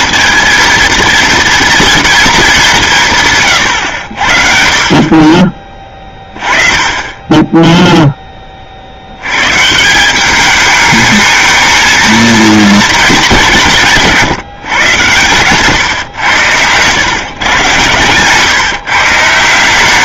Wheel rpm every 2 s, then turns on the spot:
230, 190, 50, 30, 30, 210, 230, 140, 110, 150.
none